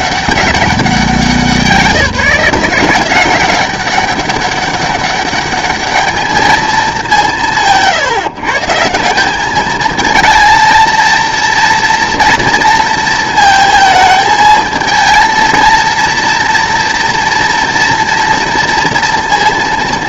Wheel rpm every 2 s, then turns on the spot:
190, 180, 200, 210, 140, 220, 230, 220, 230, 230.
none